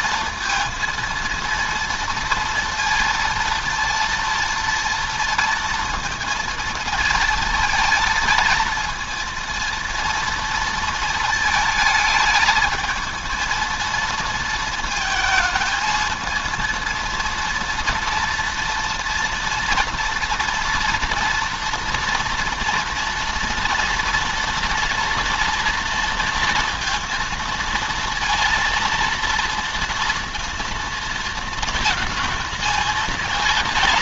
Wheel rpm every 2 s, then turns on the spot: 230, 230, 230, 230, 230, 230, 220, 220, 230, 230, 240, 230, 230, 230, 230, 230, 230.
none